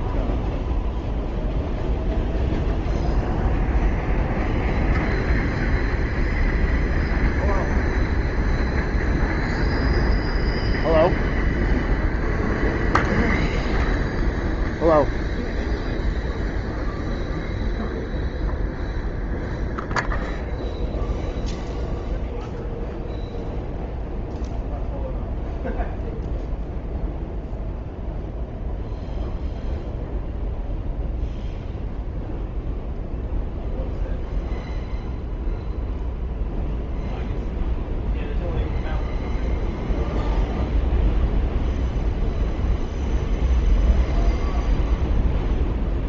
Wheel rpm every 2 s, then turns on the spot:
0, 0, 0, 0, 0, 0, 0, 0, 0, 0, 0, 0, 0, 0, 0, 0, 0, 0, 0, 0, 0, 0, 0.
none